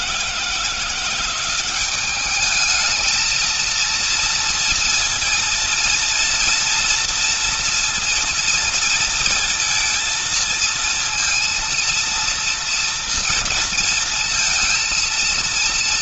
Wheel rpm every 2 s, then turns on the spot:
170, 210, 230, 230, 230, 230, 230, 230.
none